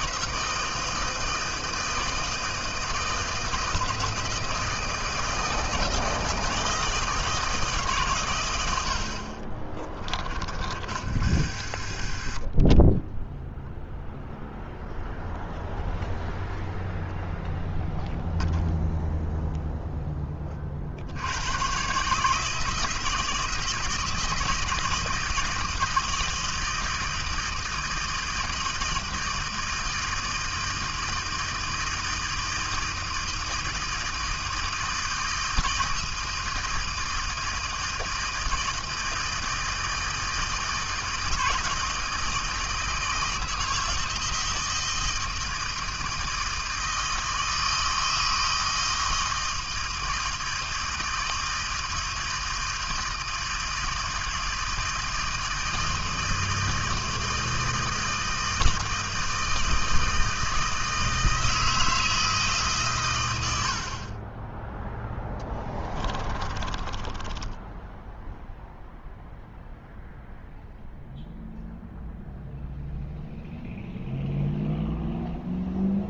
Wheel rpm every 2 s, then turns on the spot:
160, 160, 160, 160, 100, 50, 30, 0, 0, 0, 40, 160, 170, 160, 160, 160, 160, 160, 160, 160, 160, 160, 160, 160, 160, 160, 160, 160, 160, 160, 160, 150, 10, 20, 0, 0, 0, 0.
10-14 66-68